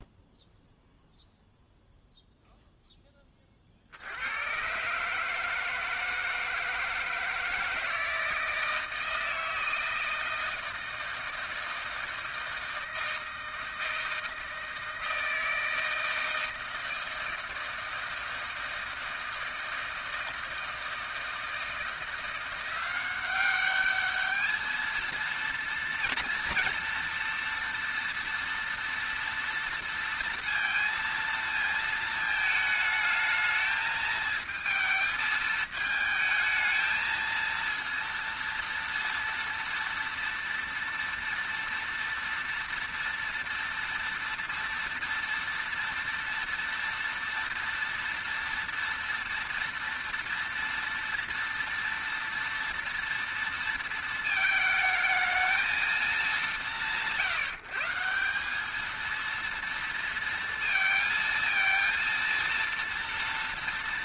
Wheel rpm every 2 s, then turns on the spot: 0, 0, 120, 160, 160, 160, 160, 160, 160, 160, 160, 180, 220, 230, 230, 230, 220, 220, 220, 230, 230, 230, 230, 240, 230, 230, 230, 220, 170, 190, 230, 230.
none